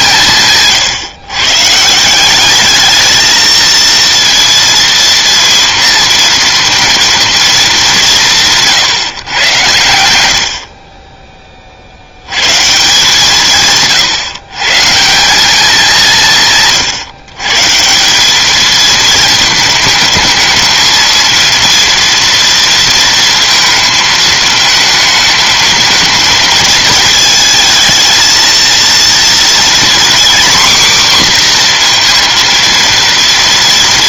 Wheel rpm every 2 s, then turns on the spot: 140, 220, 230, 230, 140, 30, 150, 150, 140, 220, 220, 230, 220, 220, 230, 250, 230.
none